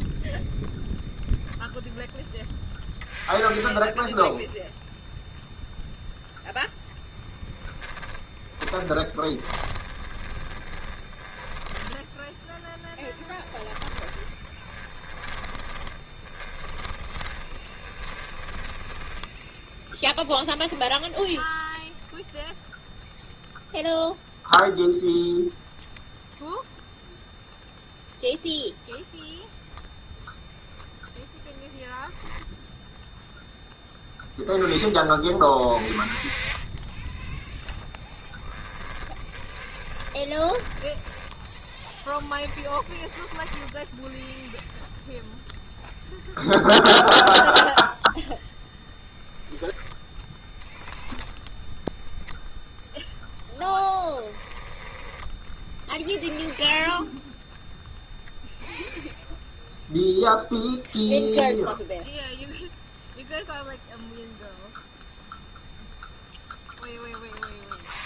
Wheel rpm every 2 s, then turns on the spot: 20, 10, 10, 0, 20, 10, 10, 20, 20, 10, 10, 0, 0, 0, 0, 0, 0, 10, 20, 10, 10, 10, 0, 0, 0, 0, 10, 10, 10, 0, 0, 0, 0, 0.
8-18 38-40 42-44